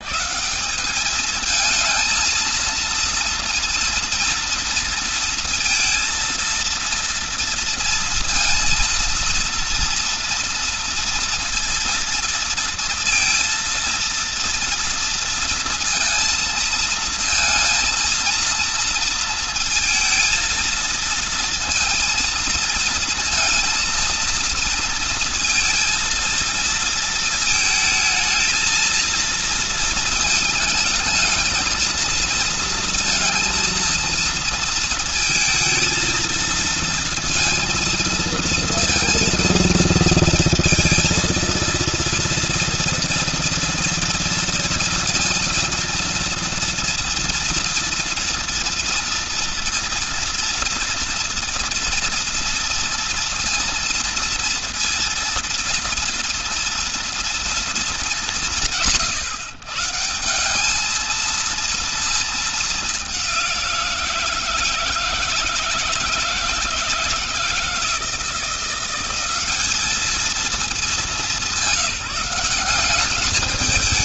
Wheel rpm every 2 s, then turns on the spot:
210, 230, 230, 230, 230, 230, 230, 230, 230, 230, 230, 230, 230, 220, 230, 220, 230, 220, 230, 230, 230, 230, 230, 230, 230, 230, 230, 230, 230, 160, 220, 200, 160, 160, 180, 200, 200.
none